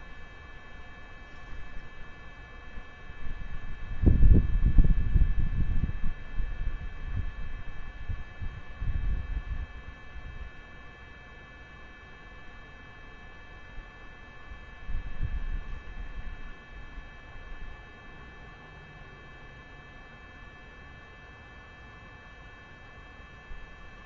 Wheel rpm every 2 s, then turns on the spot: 0, 0, 0, 0, 0, 0, 0, 0, 0, 0, 0, 0.
none